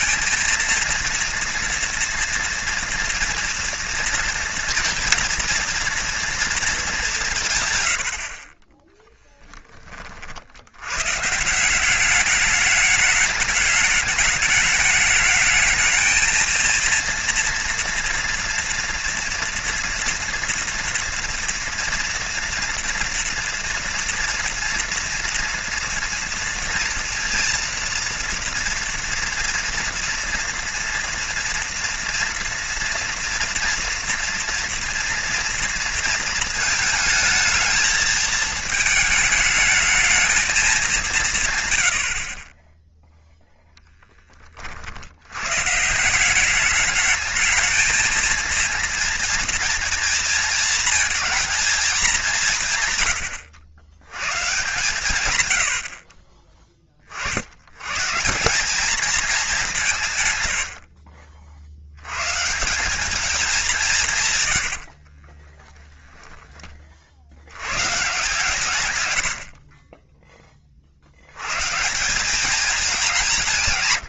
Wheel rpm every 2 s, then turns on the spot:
230, 230, 230, 210, 20, 100, 210, 210, 230, 230, 240, 230, 230, 230, 230, 240, 230, 230, 220, 220, 200, 10, 50, 200, 230, 230, 130, 130, 30, 190, 70, 180, 80, 40, 120, 30, 190.
64-66